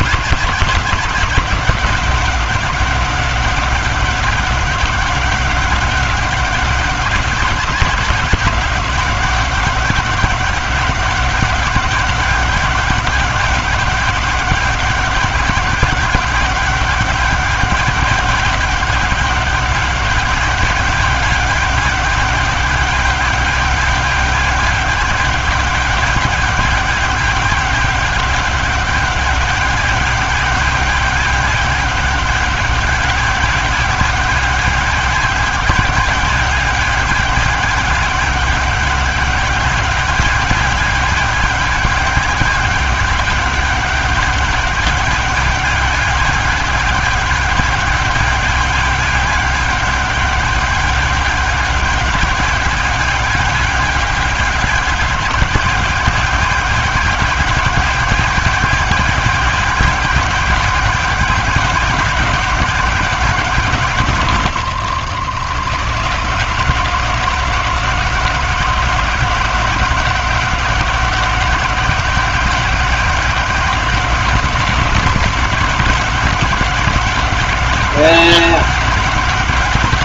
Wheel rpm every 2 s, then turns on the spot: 190, 190, 190, 190, 170, 190, 190, 190, 190, 190, 200, 200, 200, 200, 200, 200, 200, 200, 200, 200, 200, 200, 200, 200, 200, 200, 200, 200, 190, 190, 190, 180, 120, 170, 180, 180, 180, 170, 180, 180.
none